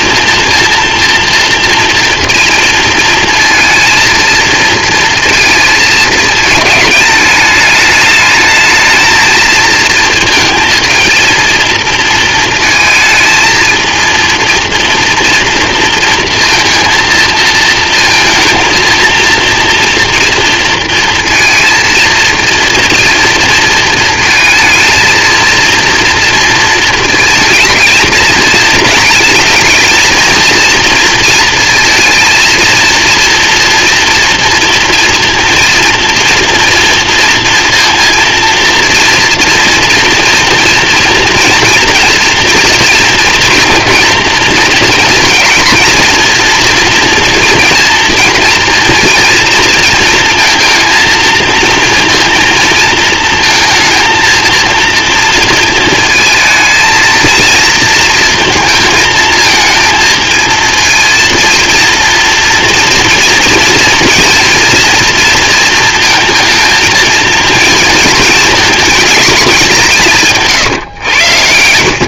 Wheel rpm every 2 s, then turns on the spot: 240, 230, 230, 220, 220, 220, 220, 240, 230, 230, 230, 230, 220, 220, 230, 230, 230, 230, 230, 230, 230, 230, 230, 240, 230, 230, 230, 230, 220, 220, 230, 230, 230, 230, 220, 110.
70-72